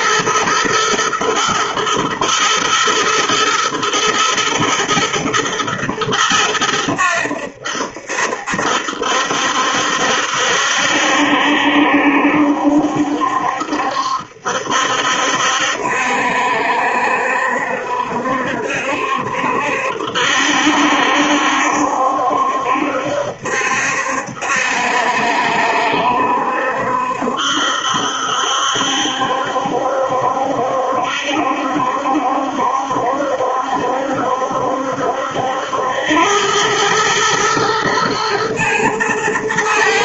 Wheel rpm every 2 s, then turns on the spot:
120, 110, 120, 100, 70, 70, 70, 70, 70, 70, 70, 70, 70, 70, 70, 70, 70, 70, 100, 110.
none